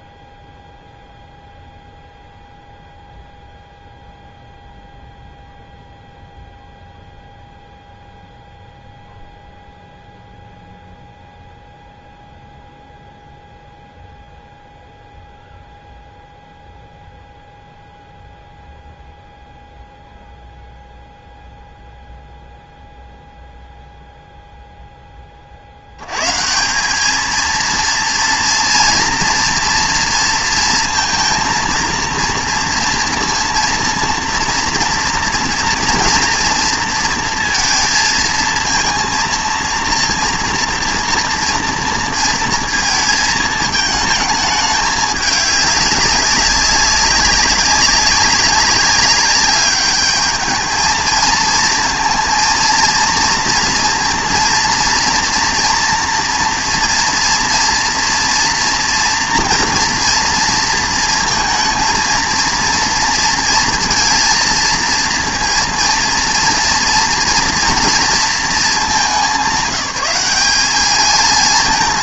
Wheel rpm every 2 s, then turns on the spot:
0, 0, 0, 0, 0, 0, 0, 0, 0, 0, 0, 0, 0, 180, 230, 230, 230, 230, 230, 230, 230, 230, 210, 190, 200, 220, 230, 230, 240, 230, 230, 230, 230, 230, 210, 210.
none